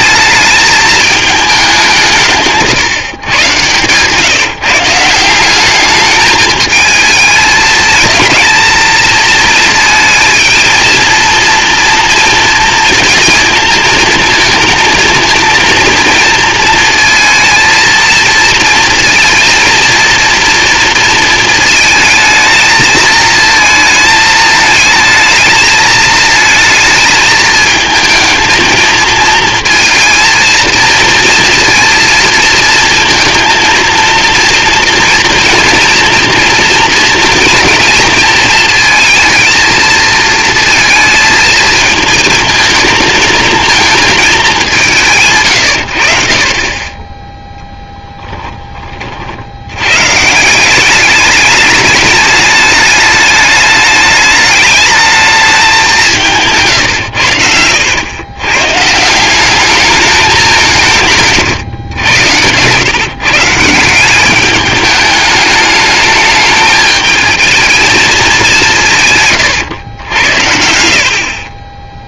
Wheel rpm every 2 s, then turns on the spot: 220, 160, 150, 220, 230, 230, 230, 220, 230, 230, 230, 220, 220, 220, 220, 230, 230, 230, 240, 230, 230, 220, 180, 30, 20, 180, 210, 210, 150, 130, 170, 120, 210, 210, 180, 70.
2-4 56-58